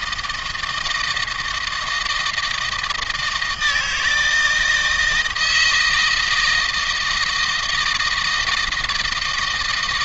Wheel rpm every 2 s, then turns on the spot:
160, 160, 160, 160, 160.
none